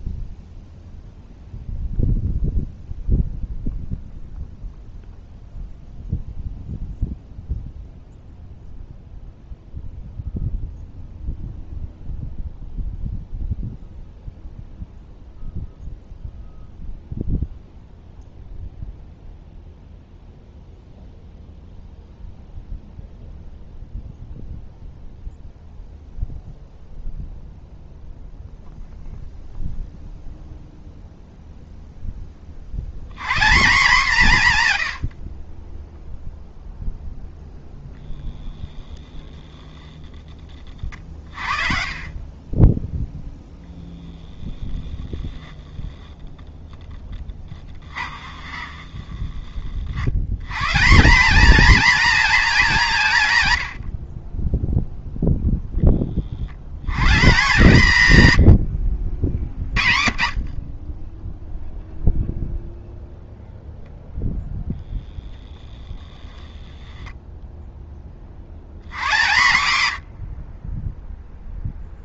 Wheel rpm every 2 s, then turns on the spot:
0, 0, 0, 0, 0, 0, 0, 0, 0, 0, 0, 0, 0, 0, 30, 160, 0, 0, 20, 20, 0, 10, 20, 90, 220, 20, 60, 120, 50, 0, 0, 0, 60, 50, 10, 50.
44-46 54-56